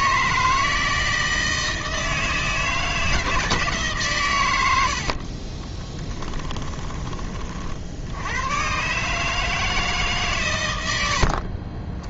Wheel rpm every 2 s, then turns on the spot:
160, 160, 70, 20, 130, 110.
4-6